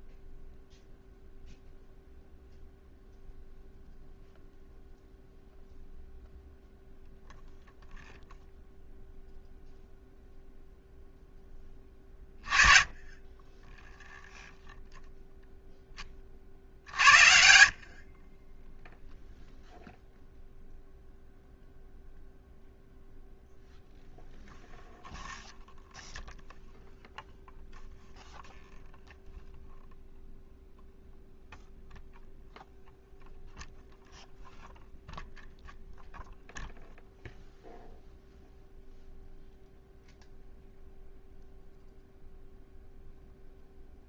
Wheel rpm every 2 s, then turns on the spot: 0, 0, 0, 0, 0, 0, 20, 0, 60, 10, 0, 0, 0, 0, 0, 0, 0, 0, 0, 0, 0, 0.
none